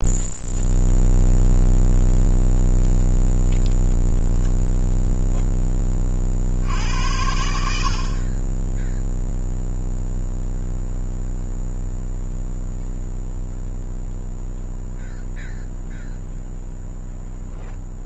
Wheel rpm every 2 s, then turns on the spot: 0, 0, 0, 70, 10, 0, 0, 0, 0.
none